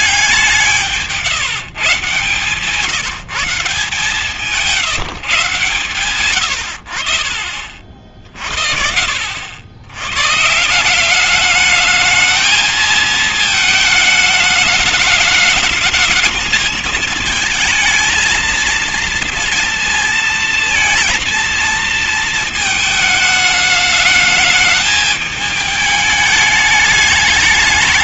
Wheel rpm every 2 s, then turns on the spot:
170, 130, 160, 110, 50, 140, 220, 210, 220, 230, 230, 220, 220, 210.
none